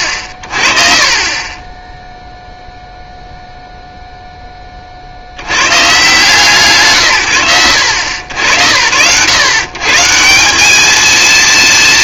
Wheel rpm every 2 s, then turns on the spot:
50, 0, 10, 150, 80, 210.
none